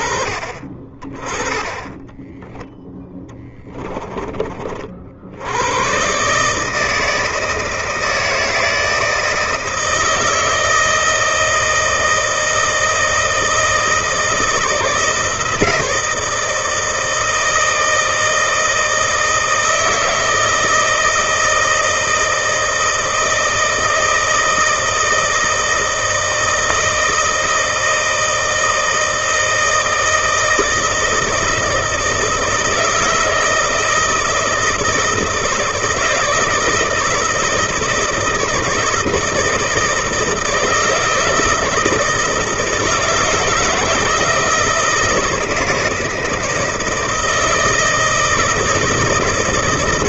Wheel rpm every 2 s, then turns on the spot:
30, 10, 40, 150, 160, 160, 160, 160, 160, 160, 160, 160, 160, 160, 160, 160, 170, 160, 160, 160, 160, 160, 160, 160, 160.
2-4